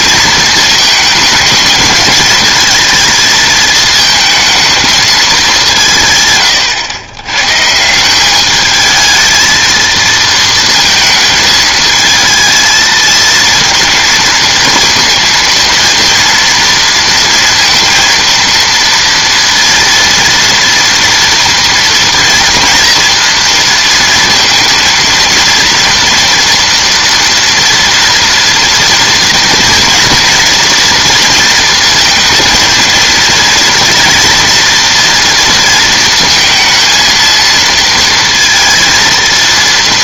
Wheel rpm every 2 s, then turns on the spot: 220, 220, 220, 110, 210, 230, 220, 230, 230, 230, 230, 230, 230, 240, 230, 230, 230, 230, 230, 230.
none